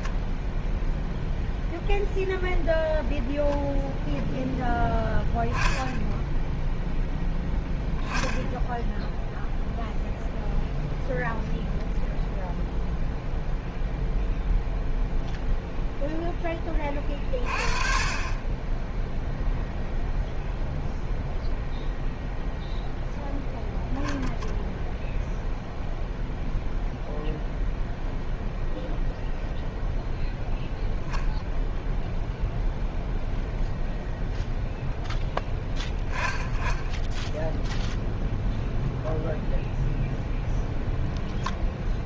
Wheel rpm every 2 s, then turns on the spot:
0, 0, 10, 10, 10, 0, 0, 0, 20, 10, 0, 0, 0, 0, 0, 0, 0, 0, 10, 0, 0.
none